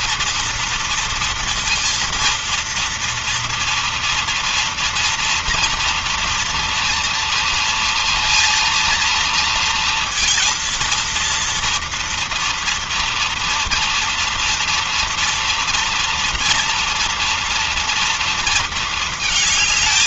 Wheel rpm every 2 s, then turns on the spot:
230, 230, 240, 230, 230, 230, 230, 230, 240, 220.
none